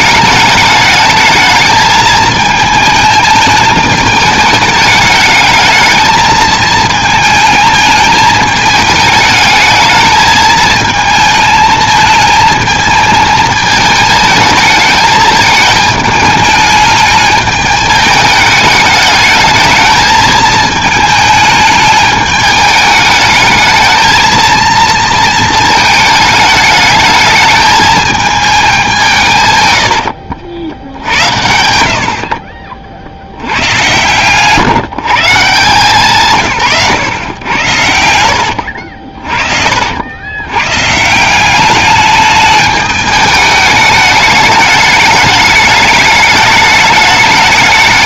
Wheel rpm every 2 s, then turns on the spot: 210, 220, 210, 220, 210, 220, 220, 220, 220, 210, 220, 210, 230, 210, 210, 70, 50, 130, 140, 70, 120, 210, 210, 210.
38-40